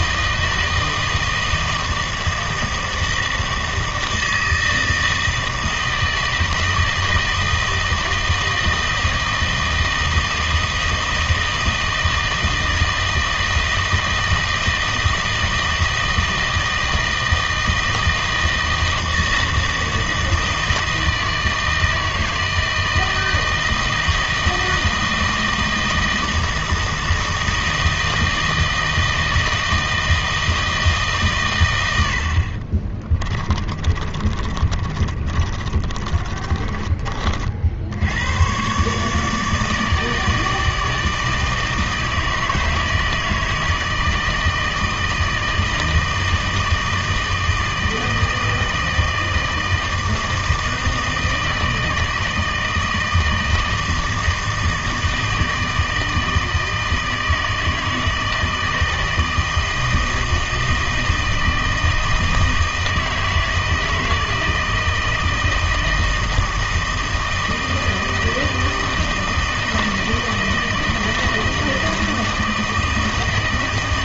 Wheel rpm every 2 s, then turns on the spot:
160, 160, 160, 160, 160, 160, 160, 160, 160, 160, 160, 160, 160, 160, 160, 160, 40, 30, 30, 120, 160, 160, 160, 160, 160, 160, 160, 160, 160, 160, 160, 160, 160, 160, 160, 160, 160.
32-38